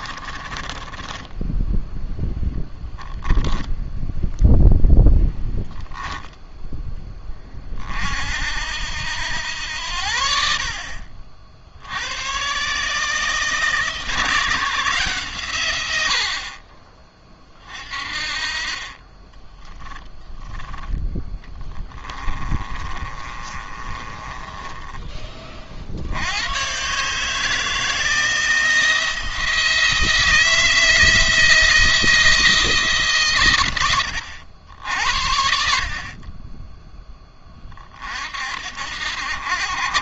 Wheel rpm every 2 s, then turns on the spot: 20, 10, 0, 0, 70, 60, 120, 160, 50, 40, 10, 20, 10, 110, 170, 160, 160, 80, 20, 60.
0-4 22-26